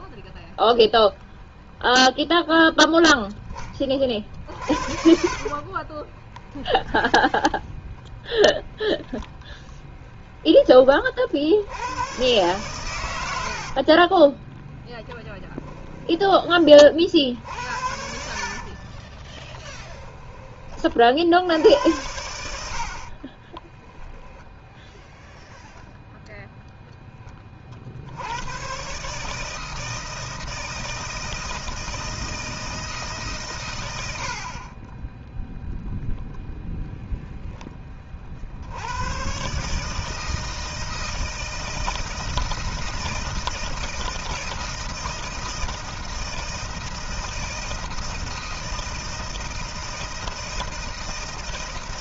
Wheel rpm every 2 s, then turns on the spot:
0, 0, 40, 10, 10, 20, 110, 10, 30, 40, 40, 70, 0, 0, 120, 160, 160, 40, 0, 80, 160, 160, 160, 160, 160, 160.
4-8 14-16 18-20